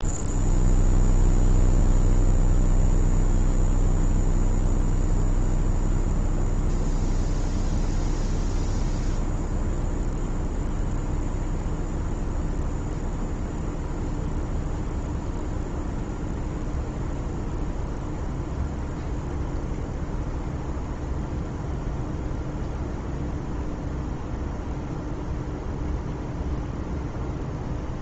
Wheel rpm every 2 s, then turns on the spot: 0, 0, 0, 0, 0, 0, 0, 0, 0, 0, 0, 0, 0, 0.
none